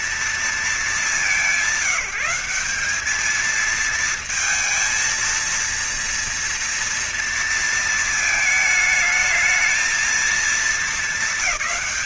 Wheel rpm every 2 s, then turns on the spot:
230, 180, 230, 230, 220, 220.
none